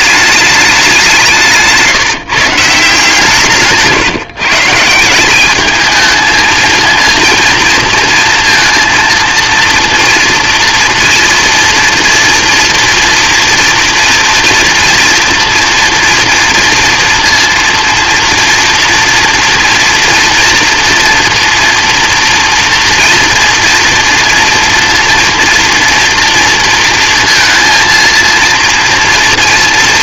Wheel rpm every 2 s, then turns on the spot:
190, 150, 170, 230, 230, 230, 230, 230, 230, 230, 230, 230, 230, 230, 230.
none